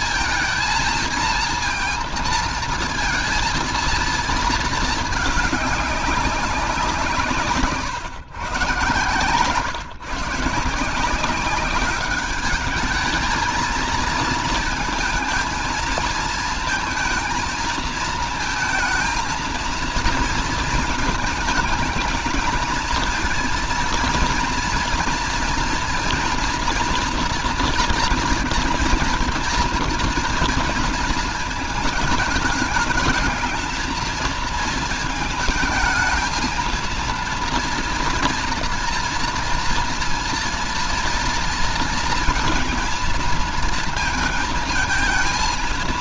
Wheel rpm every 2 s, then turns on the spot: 230, 230, 220, 190, 130, 160, 210, 230, 230, 230, 220, 220, 230, 230, 240, 230, 220, 230, 220, 230, 230, 230, 230.
none